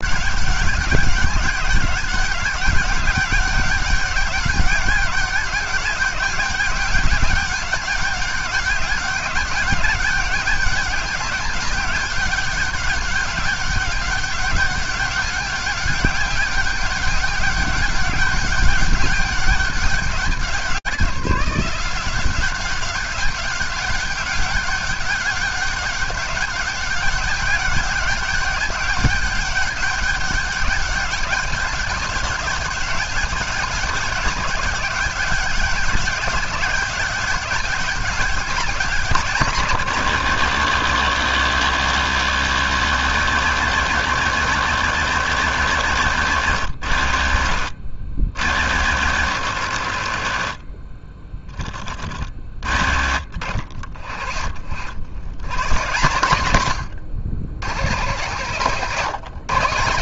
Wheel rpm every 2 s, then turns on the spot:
200, 200, 200, 200, 200, 200, 200, 200, 200, 200, 180, 200, 200, 200, 200, 200, 200, 190, 200, 170, 90, 100, 100, 60, 70, 20, 50, 80, 90, 170.
none